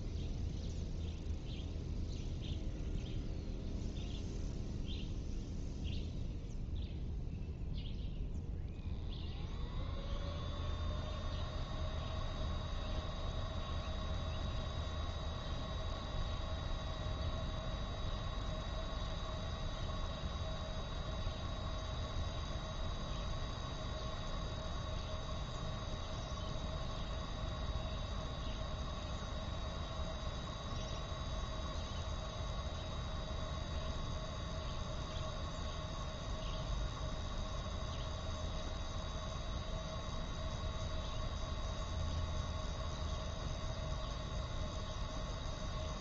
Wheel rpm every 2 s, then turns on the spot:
0, 0, 0, 0, 0, 0, 0, 0, 0, 0, 0, 0, 0, 0, 0, 0, 0, 0, 0, 0, 0, 0, 0.
none